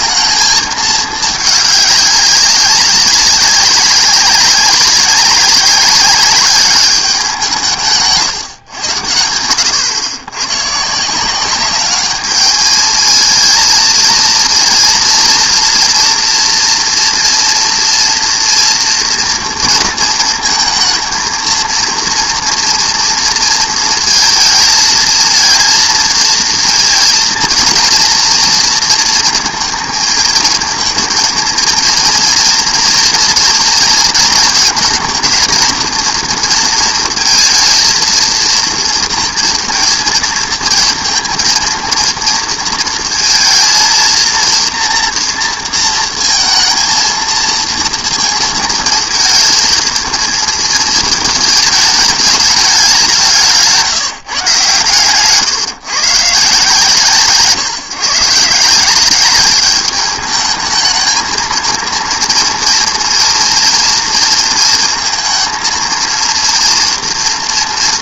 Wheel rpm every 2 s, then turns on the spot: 220, 200, 190, 200, 140, 120, 210, 230, 230, 240, 230, 230, 220, 230, 230, 220, 230, 230, 230, 230, 220, 230, 230, 220, 220, 220, 210, 140, 150, 160, 220, 230, 230, 230.
none